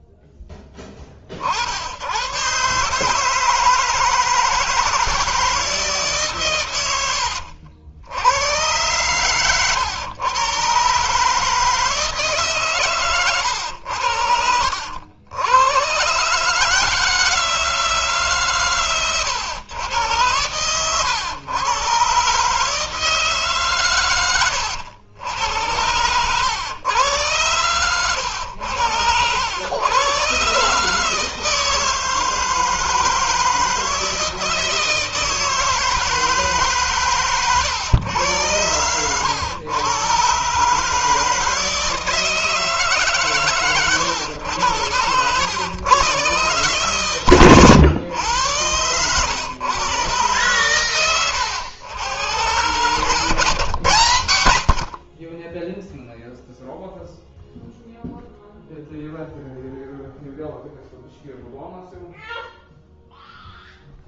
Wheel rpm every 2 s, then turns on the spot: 0, 100, 160, 130, 90, 120, 150, 90, 140, 140, 100, 130, 110, 110, 100, 130, 160, 160, 150, 100, 130, 160, 100, 130, 110, 120, 110, 100, 0, 0, 0, 0.
24-26